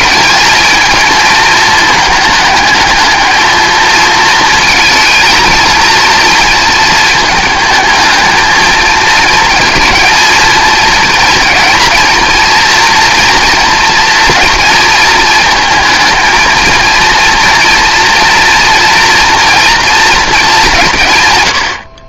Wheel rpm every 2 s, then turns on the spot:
220, 220, 230, 220, 220, 230, 230, 230, 230, 240, 200.
none